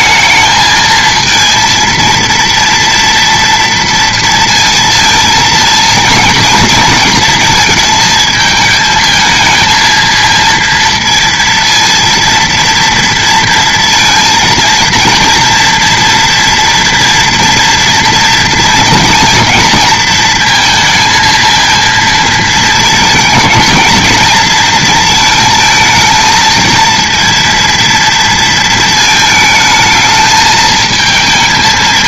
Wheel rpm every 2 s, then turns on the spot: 220, 230, 230, 220, 220, 230, 230, 220, 230, 230, 230, 220, 230, 230, 220, 220.
none